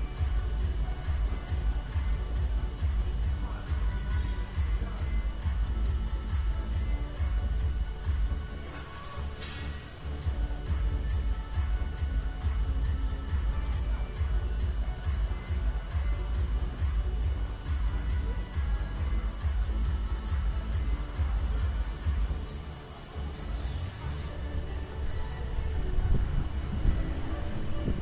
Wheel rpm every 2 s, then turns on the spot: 0, 0, 0, 0, 0, 0, 0, 0, 0, 0, 0, 0, 0, 0.
none